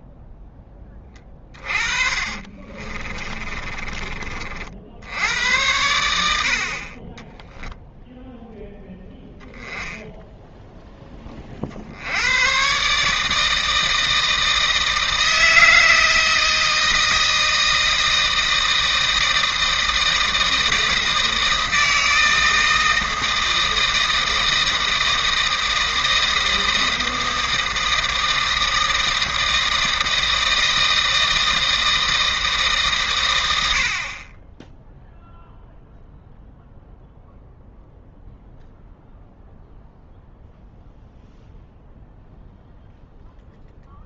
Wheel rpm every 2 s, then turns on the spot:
10, 40, 80, 30, 10, 10, 130, 160, 160, 160, 160, 160, 160, 160, 160, 160, 150, 10, 0, 0, 0, 0.
2-4